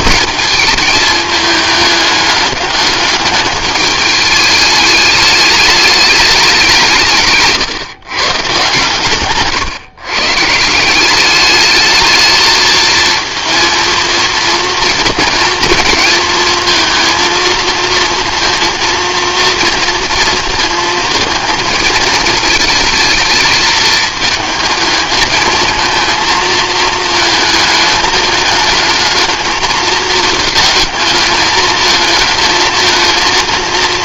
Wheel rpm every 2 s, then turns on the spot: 220, 210, 210, 190, 140, 170, 220, 230, 230, 230, 220, 220, 220, 230, 220, 220, 220.
none